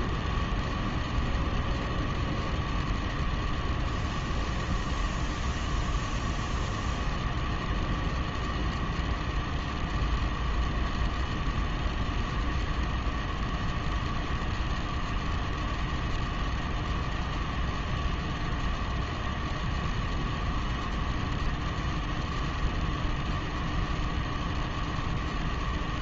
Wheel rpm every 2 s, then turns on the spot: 0, 0, 0, 0, 0, 0, 0, 0, 0, 0, 0, 0, 0.
none